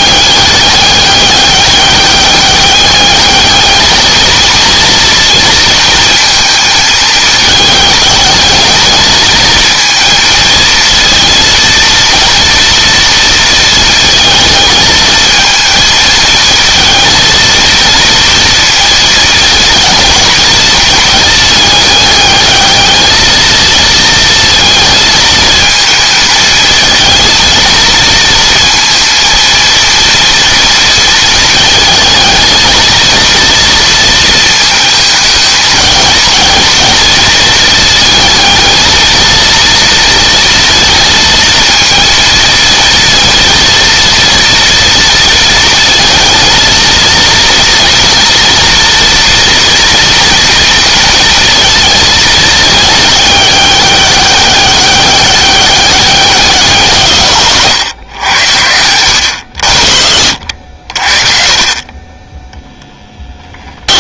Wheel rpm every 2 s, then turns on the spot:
200, 200, 220, 220, 220, 230, 230, 220, 220, 230, 230, 210, 230, 220, 230, 230, 220, 220, 220, 220, 230, 230, 230, 230, 230, 230, 220, 200, 170, 90, 60, 0.
60-62